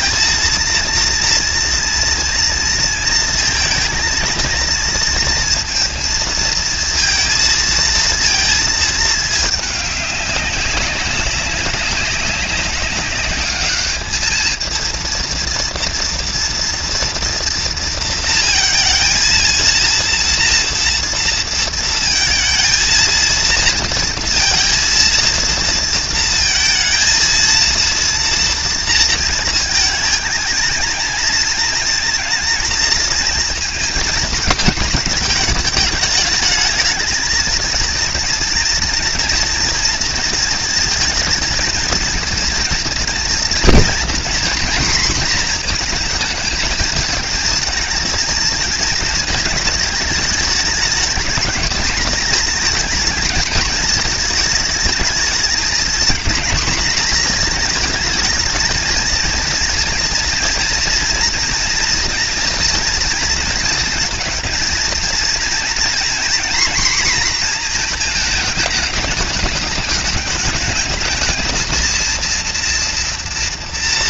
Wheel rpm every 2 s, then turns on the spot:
230, 230, 230, 230, 220, 200, 200, 230, 240, 230, 230, 230, 230, 230, 230, 230, 220, 220, 220, 230, 230, 230, 240, 220, 230, 210, 220, 220, 240, 230, 230, 230, 230, 240, 220, 210, 240.
none